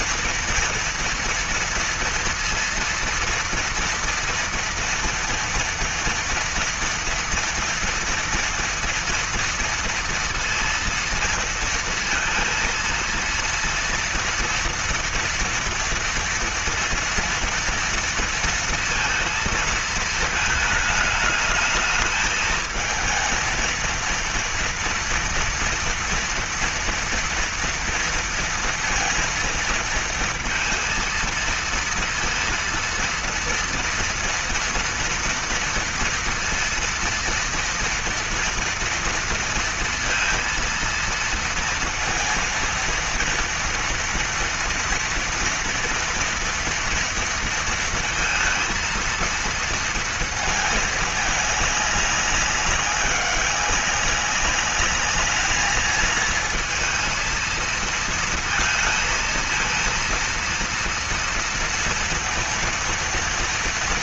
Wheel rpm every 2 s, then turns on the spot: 230, 230, 230, 230, 230, 230, 230, 230, 230, 230, 210, 220, 230, 230, 230, 230, 230, 230, 230, 230, 230, 230, 230, 230, 230, 220, 200, 200, 220, 230, 230, 230.
none